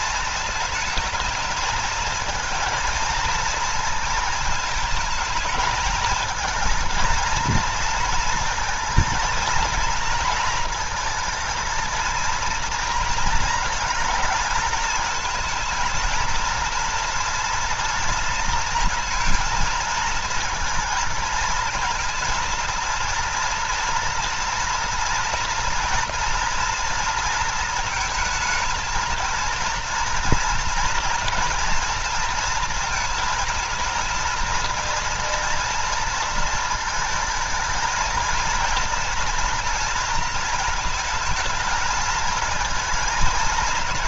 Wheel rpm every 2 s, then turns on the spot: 220, 220, 220, 220, 230, 230, 230, 220, 230, 220, 230, 230, 230, 240, 230, 230, 230, 230, 230, 230, 230, 220.
none